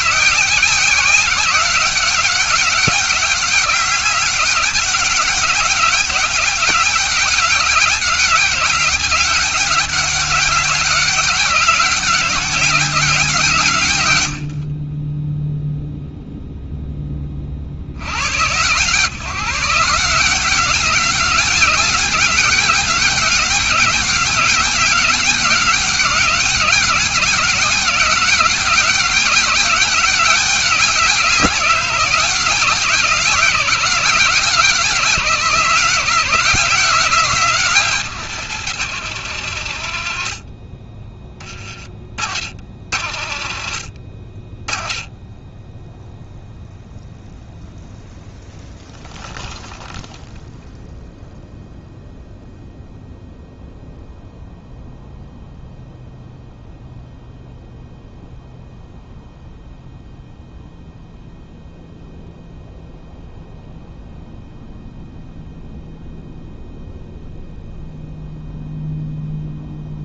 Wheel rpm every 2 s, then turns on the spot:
180, 190, 190, 200, 200, 190, 180, 30, 10, 130, 190, 200, 190, 190, 190, 190, 180, 180, 160, 140, 20, 60, 20, 0, 0, 0, 0, 0, 0, 0, 0, 0, 0, 0, 0.
none